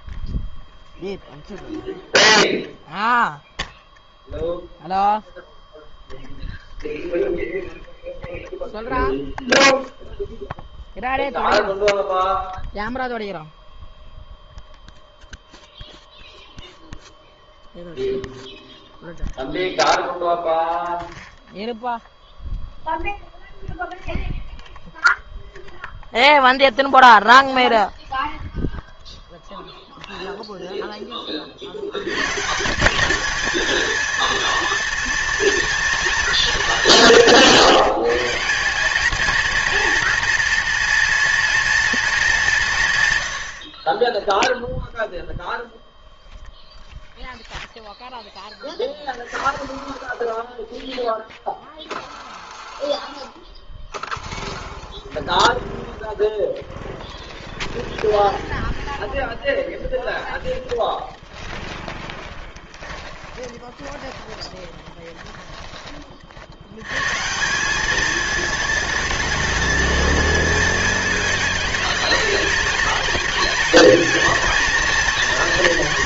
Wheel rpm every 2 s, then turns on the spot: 0, 0, 0, 0, 0, 0, 0, 0, 0, 0, 0, 0, 0, 0, 0, 0, 160, 230, 200, 190, 230, 160, 0, 0, 0, 0, 0, 0, 0, 30, 10, 20, 10, 80, 220, 220, 210, 230.
58-66